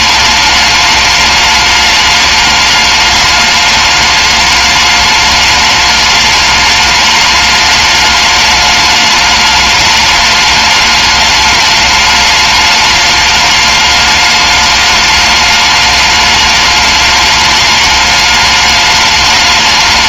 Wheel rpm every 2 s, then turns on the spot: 210, 210, 210, 210, 210, 210, 210, 210, 210, 210.
none